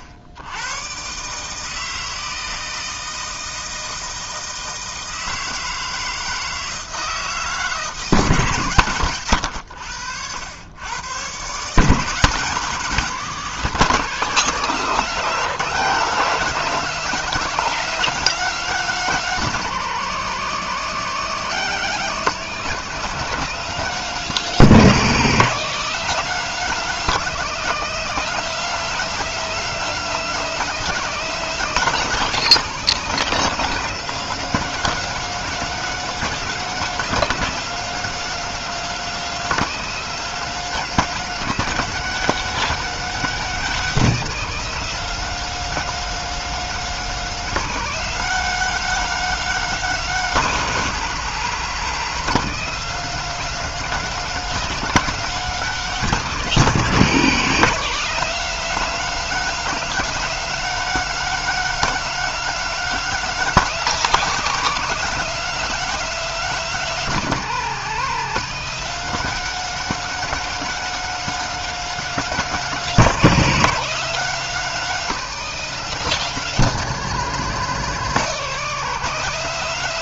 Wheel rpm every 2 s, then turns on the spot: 100, 160, 160, 160, 130, 100, 180, 190, 200, 210, 190, 190, 200, 210, 210, 210, 200, 210, 210, 210, 210, 220, 210, 210, 210, 170, 180, 210, 190, 200, 210, 210, 200, 200, 190, 210, 200, 200, 190, 200.
none